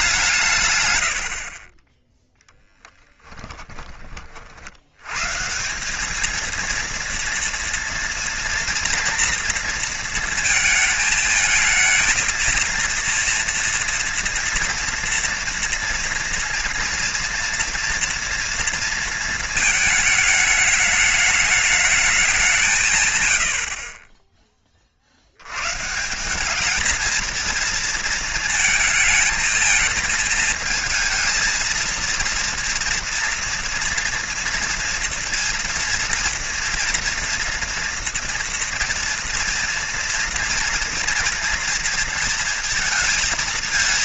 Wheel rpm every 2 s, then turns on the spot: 110, 10, 80, 230, 230, 220, 230, 230, 230, 230, 210, 150, 40, 220, 230, 220, 230, 230, 230, 230, 240, 230.
2-4